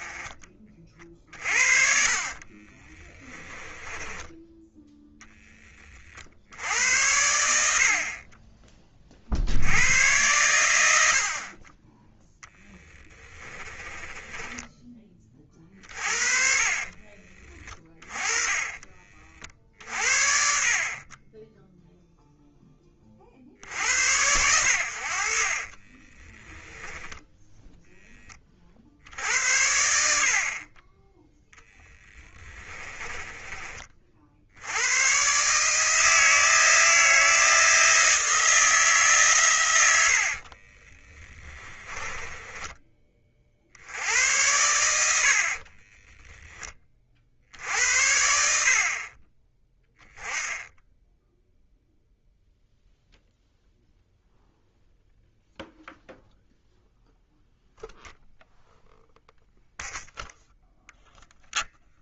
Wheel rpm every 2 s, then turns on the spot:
30, 30, 10, 90, 20, 90, 10, 20, 40, 30, 50, 20, 80, 10, 50, 30, 20, 90, 160, 160, 30, 20, 80, 30, 50, 10, 0, 0, 0, 0, 0.
2-4 12-14 16-18 26-28 32-34 40-42